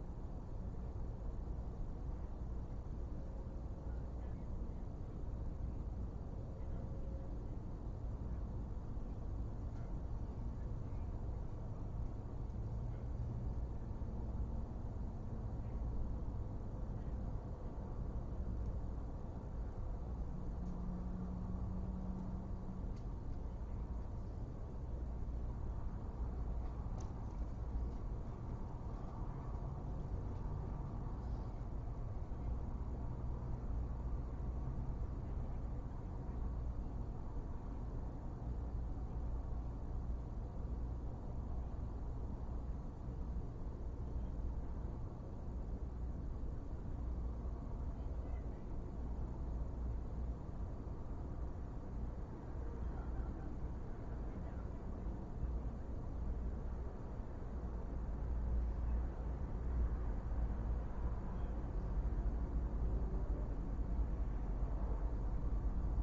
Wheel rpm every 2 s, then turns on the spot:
0, 0, 0, 0, 0, 0, 0, 0, 0, 0, 0, 0, 0, 0, 0, 0, 0, 0, 0, 0, 0, 0, 0, 0, 0, 0, 0, 0, 0, 0, 0, 0, 0.
none